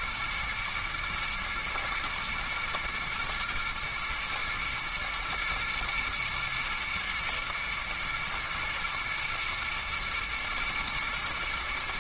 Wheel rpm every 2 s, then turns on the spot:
120, 120, 120, 110, 110, 110.
none